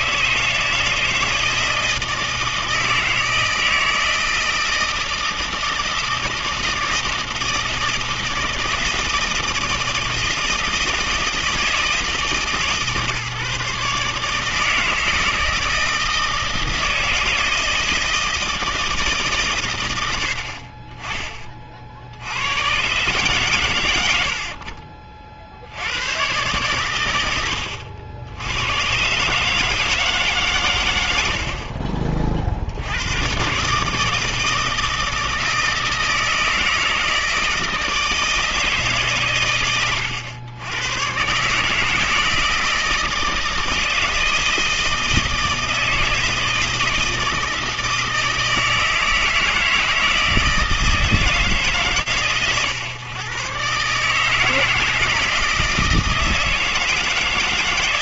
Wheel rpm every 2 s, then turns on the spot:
160, 160, 160, 160, 160, 160, 140, 160, 160, 160, 40, 100, 60, 120, 100, 140, 60, 160, 160, 160, 100, 160, 160, 160, 160, 160, 120, 160, 160.
24-26